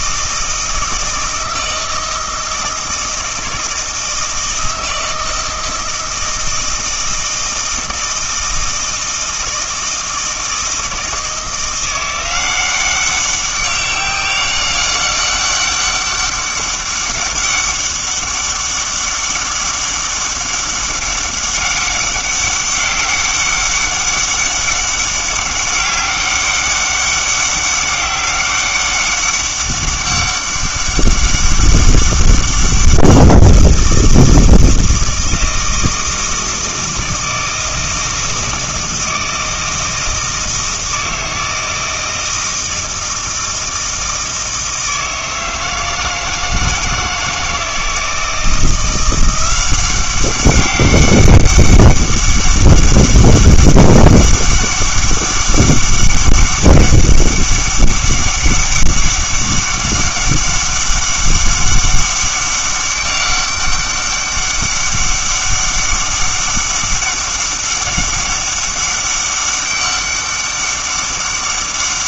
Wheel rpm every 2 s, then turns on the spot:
160, 160, 160, 160, 160, 160, 180, 200, 200, 200, 200, 200, 200, 200, 190, 190, 190, 160, 160, 160, 160, 160, 160, 160, 170, 200, 200, 200, 200, 200, 200, 200, 200, 200, 200, 200.
none